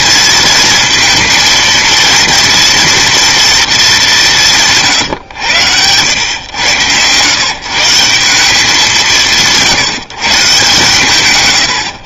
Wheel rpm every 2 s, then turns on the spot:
220, 230, 160, 110, 190, 150.
none